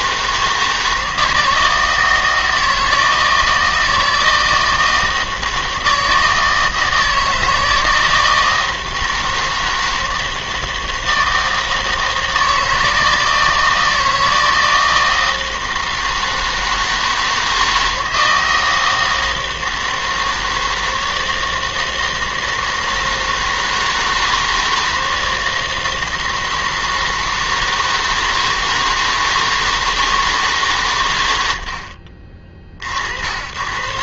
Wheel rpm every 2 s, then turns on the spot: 160, 160, 160, 160, 160, 160, 160, 160, 160, 160, 160, 160, 160, 160, 160, 140, 40.
none